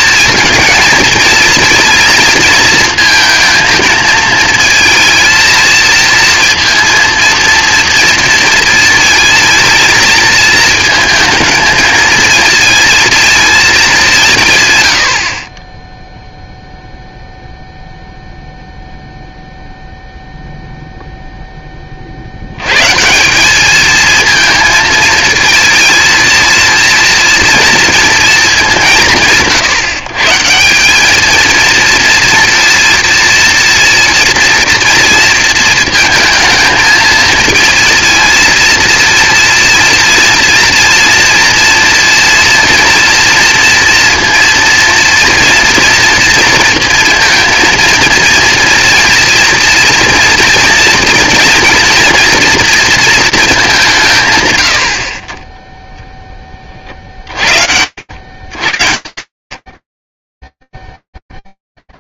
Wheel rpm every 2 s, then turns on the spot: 230, 230, 230, 230, 230, 220, 230, 130, 0, 0, 0, 110, 230, 230, 200, 180, 230, 230, 220, 230, 230, 230, 230, 230, 230, 230, 230, 90, 40, 110, 10.
none